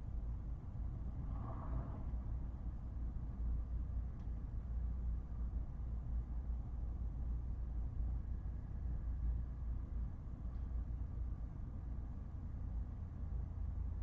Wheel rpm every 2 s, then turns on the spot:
0, 0, 0, 0, 0, 0, 0.
none